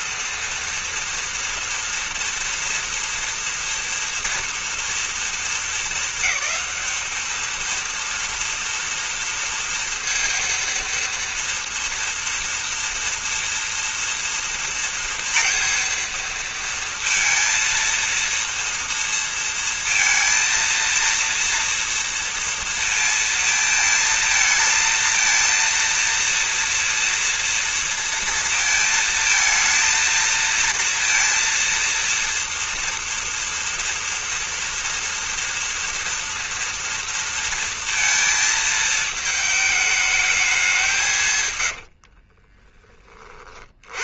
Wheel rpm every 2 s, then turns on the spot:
230, 230, 230, 220, 230, 230, 230, 230, 230, 230, 230, 230, 230, 230, 230, 230, 230, 240, 230, 230, 210, 60.
42-44